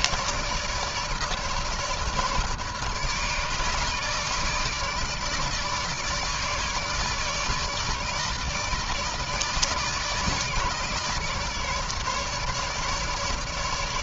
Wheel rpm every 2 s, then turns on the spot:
160, 150, 150, 150, 150, 150, 150.
none